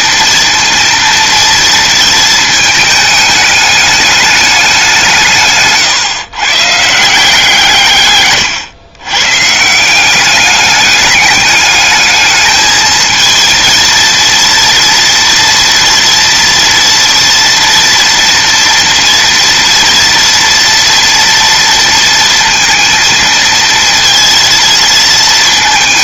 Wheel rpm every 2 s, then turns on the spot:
230, 220, 190, 150, 110, 200, 220, 230, 230, 230, 230, 230, 230.
none